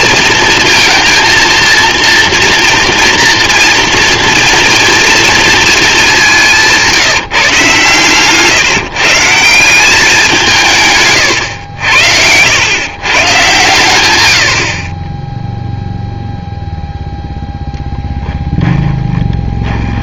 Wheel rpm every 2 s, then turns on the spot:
230, 230, 230, 170, 150, 170, 110, 50, 0, 20.
18-20